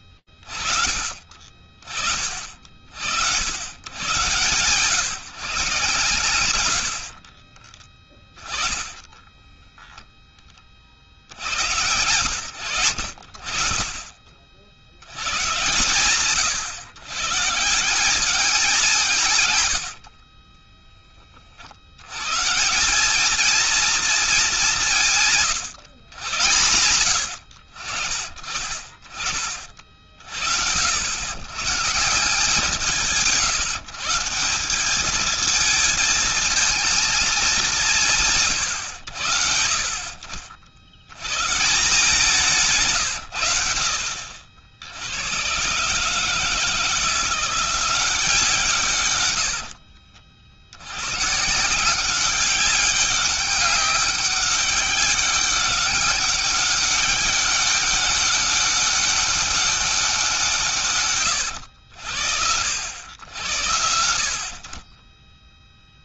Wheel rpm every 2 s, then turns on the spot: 50, 80, 130, 60, 20, 70, 50, 100, 140, 140, 30, 210, 160, 90, 30, 100, 170, 210, 220, 70, 90, 140, 100, 170, 130, 90, 190, 200, 200, 200, 130, 80, 40.
6-10 18-20